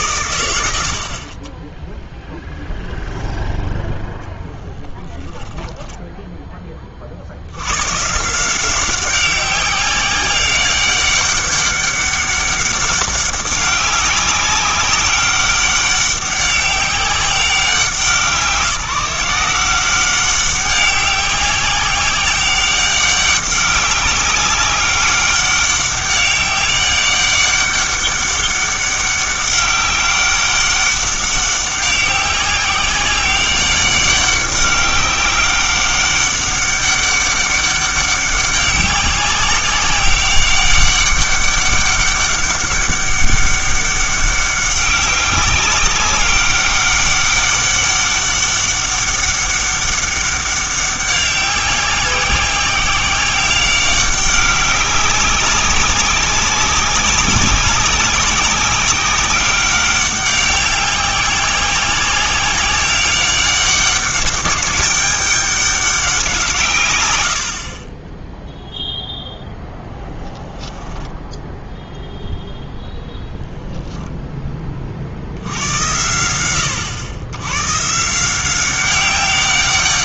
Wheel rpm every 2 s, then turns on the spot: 80, 0, 10, 30, 180, 190, 200, 190, 200, 180, 200, 190, 200, 200, 200, 200, 190, 200, 200, 200, 200, 200, 200, 200, 200, 190, 190, 200, 190, 190, 190, 190, 200, 140, 0, 10, 0, 30, 100, 180.
none